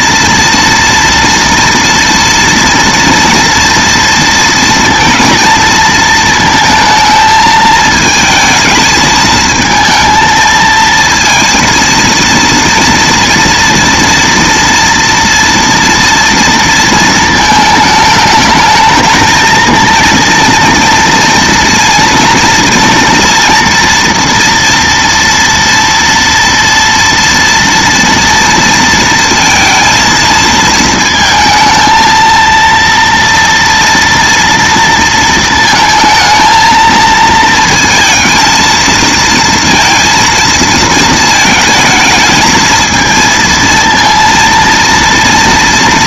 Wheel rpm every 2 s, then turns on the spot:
230, 230, 230, 220, 220, 230, 230, 230, 230, 220, 230, 230, 230, 230, 230, 230, 230, 230, 230, 220, 230, 220, 230.
none